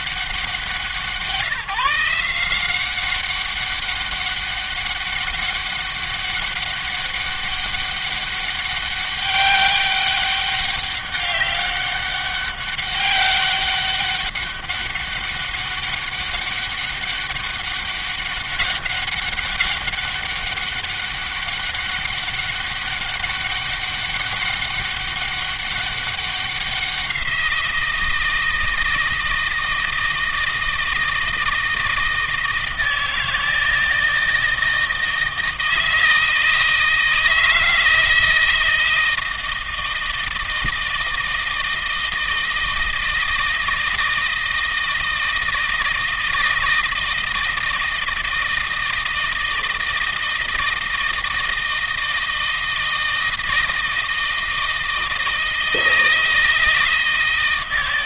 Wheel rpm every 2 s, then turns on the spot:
170, 190, 200, 200, 200, 200, 200, 190, 200, 200, 200, 200, 200, 180, 160, 160, 160, 160, 160, 160, 160, 160, 160, 160, 160, 160, 160, 160, 160.
none